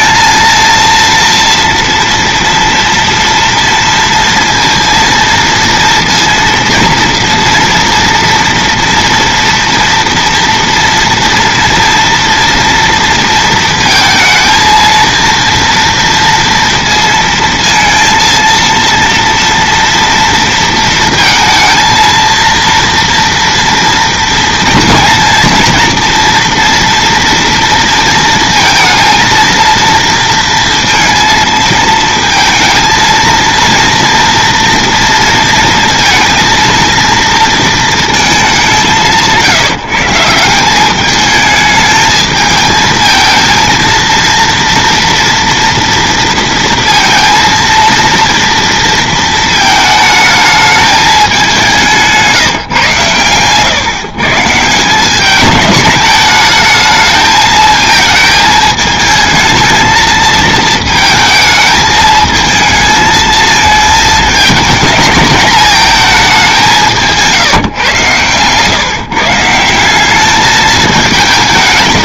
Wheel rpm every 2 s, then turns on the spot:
230, 230, 230, 230, 230, 230, 230, 230, 230, 230, 230, 230, 230, 230, 230, 230, 220, 230, 230, 180, 190, 220, 230, 230, 230, 210, 130, 170, 220, 220, 220, 220, 210, 180, 140, 210.
none